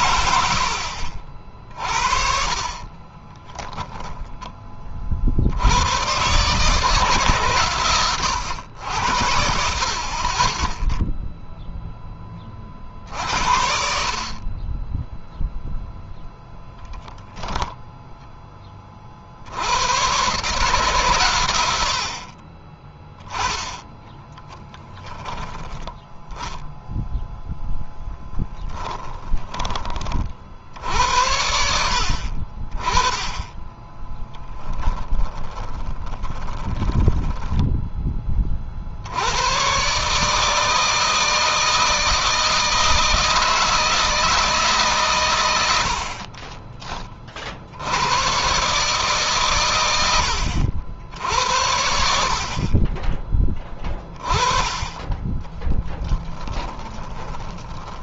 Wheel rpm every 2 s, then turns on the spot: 60, 30, 30, 140, 80, 10, 50, 20, 0, 30, 130, 20, 20, 0, 10, 70, 40, 10, 10, 50, 160, 160, 150, 20, 140, 80, 30, 20, 20.
0-4 22-26 28-30 34-38 54-58